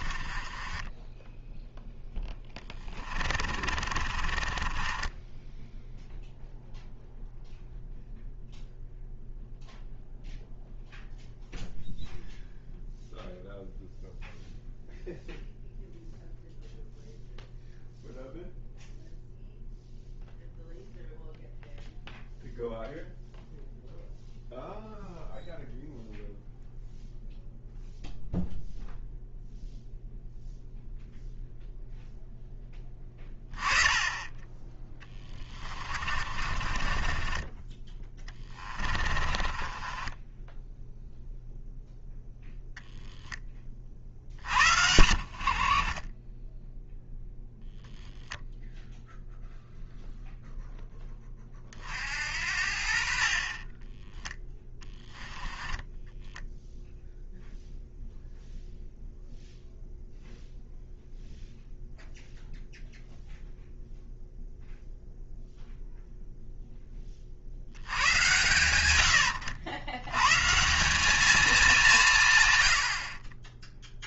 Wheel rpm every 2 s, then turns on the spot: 20, 20, 20, 0, 0, 0, 0, 0, 0, 0, 0, 0, 0, 0, 0, 0, 10, 20, 30, 30, 10, 0, 60, 0, 0, 0, 50, 10, 0, 0, 0, 0, 0, 20, 90, 190, 90.
0-6 34-40 54-56